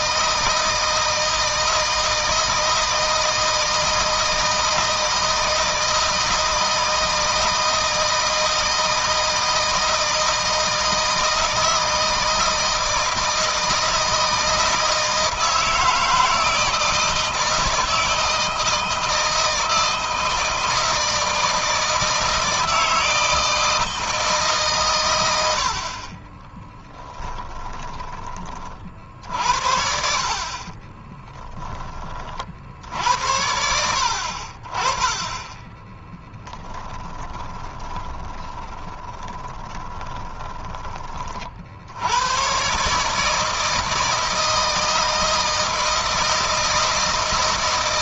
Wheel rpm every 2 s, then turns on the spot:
160, 160, 160, 160, 160, 160, 160, 160, 160, 160, 160, 160, 140, 20, 40, 50, 60, 40, 10, 20, 20, 120, 160, 160.
26-28 30-32 36-40